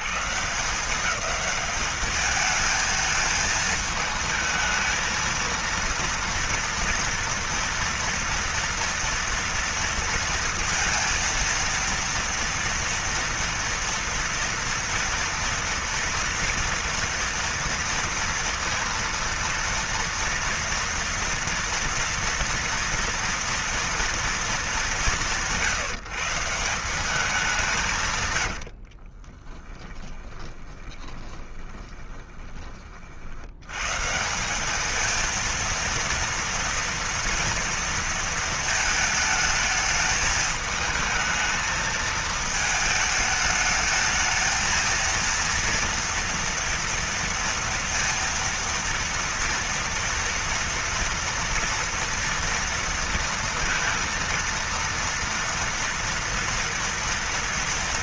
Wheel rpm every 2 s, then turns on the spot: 110, 210, 220, 230, 230, 230, 230, 230, 230, 230, 230, 230, 230, 160, 140, 20, 20, 140, 230, 230, 220, 220, 220, 230, 230, 230, 230, 230, 240.
30-34